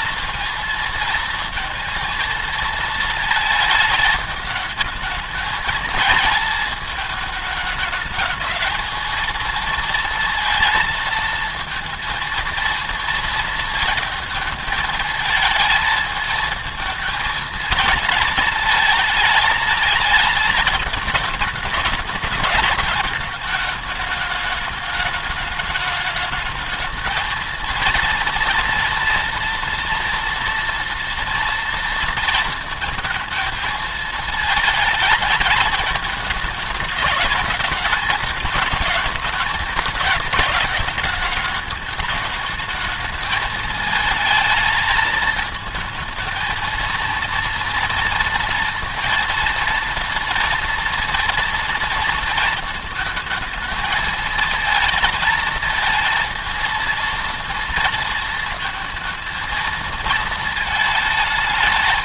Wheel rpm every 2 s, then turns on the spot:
230, 230, 210, 220, 220, 230, 230, 220, 220, 220, 220, 220, 210, 210, 230, 230, 230, 220, 210, 210, 220, 220, 220, 220, 230, 230, 230, 230, 220, 230, 220.
none